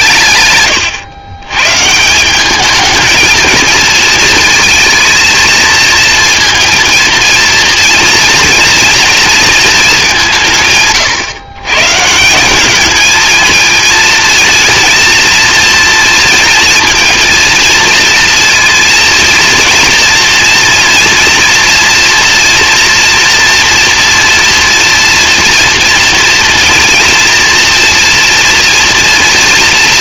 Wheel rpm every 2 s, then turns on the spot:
100, 220, 230, 230, 230, 140, 220, 230, 230, 230, 230, 240, 230, 230, 240.
none